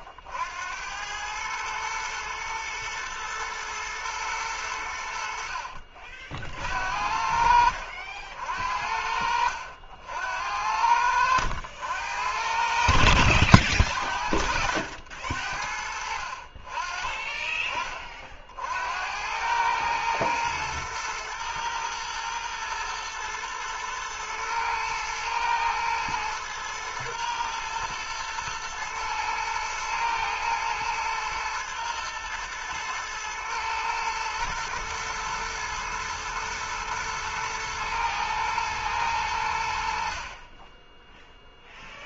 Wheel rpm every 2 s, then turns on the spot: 90, 110, 80, 60, 60, 80, 70, 70, 30, 70, 120, 120, 110, 110, 110, 110, 120, 110, 110, 110, 10.
12-14